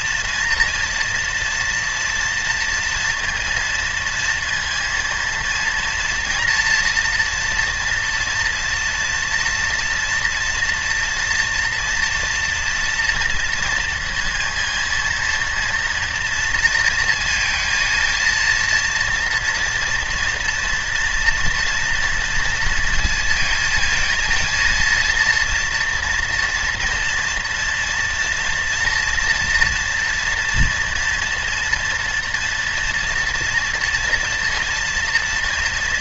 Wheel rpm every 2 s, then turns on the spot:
230, 240, 230, 240, 240, 240, 230, 230, 230, 230, 230, 230, 230, 230, 230, 230, 230, 230.
none